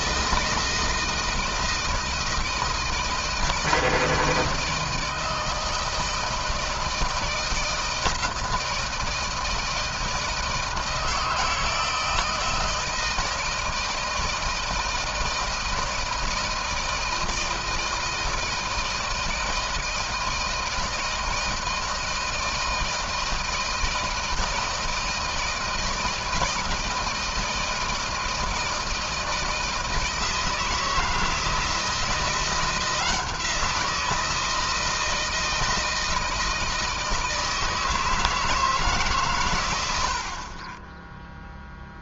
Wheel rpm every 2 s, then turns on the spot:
160, 160, 160, 160, 160, 160, 160, 160, 160, 160, 160, 160, 160, 160, 160, 160, 170, 160, 160, 150, 20.
none